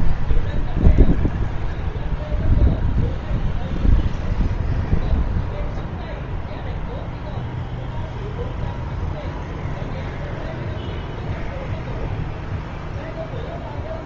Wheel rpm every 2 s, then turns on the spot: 0, 0, 0, 0, 0, 0, 0.
none